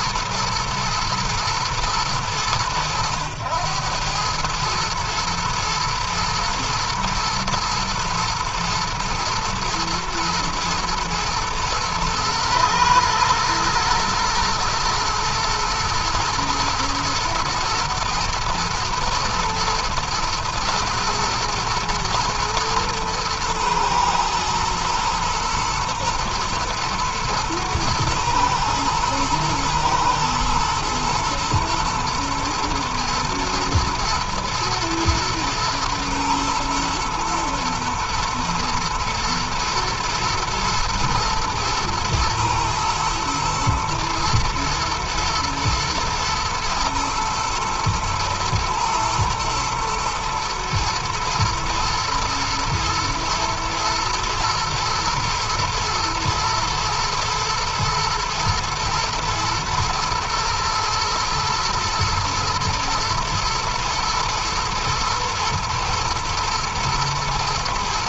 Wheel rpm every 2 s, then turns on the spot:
110, 90, 110, 110, 110, 110, 110, 120, 120, 110, 120, 110, 110, 110, 110, 120, 120, 110, 120, 110, 110, 110, 110, 110, 110, 110, 110, 120, 110, 120, 120, 120, 110, 120.
none